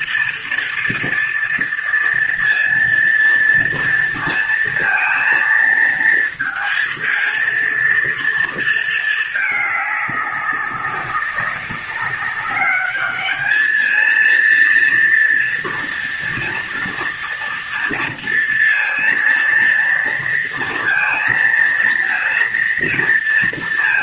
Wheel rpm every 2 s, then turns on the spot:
230, 230, 230, 220, 230, 200, 200, 230, 230, 230, 230, 230.
none